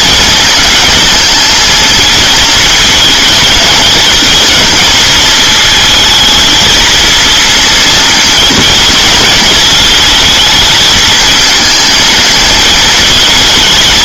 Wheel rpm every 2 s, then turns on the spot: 220, 220, 230, 220, 230, 220, 220.
none